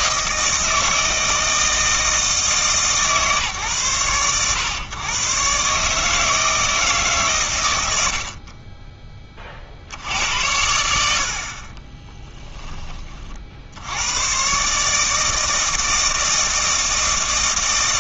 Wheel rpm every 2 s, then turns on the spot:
160, 150, 120, 160, 30, 80, 20, 150, 160.
none